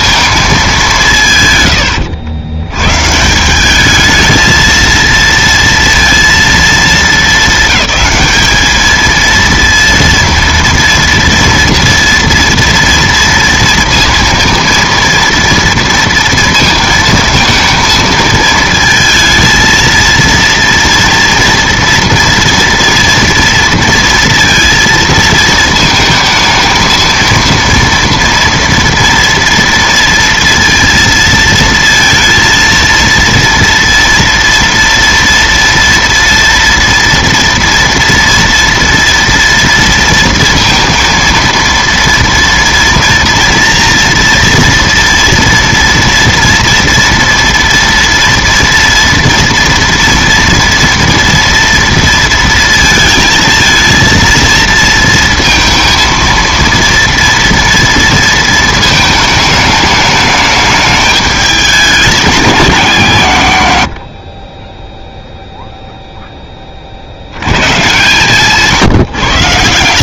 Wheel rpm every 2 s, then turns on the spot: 210, 110, 230, 220, 210, 230, 230, 230, 230, 220, 230, 230, 230, 220, 230, 230, 230, 230, 230, 230, 230, 230, 240, 230, 230, 230, 230, 230, 230, 220, 210, 180, 20, 20, 150.
none